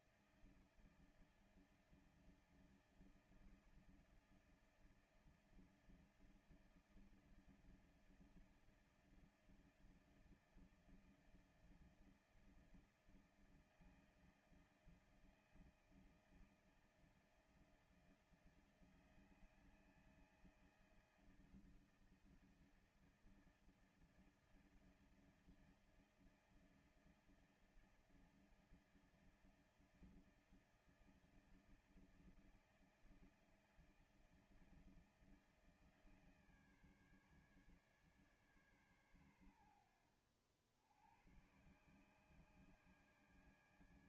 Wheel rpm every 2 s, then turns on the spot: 160, 160, 160, 160, 160, 160, 160, 160, 160, 160, 160, 160, 160, 160, 160, 160, 160, 160, 160, 150, 80, 140.
none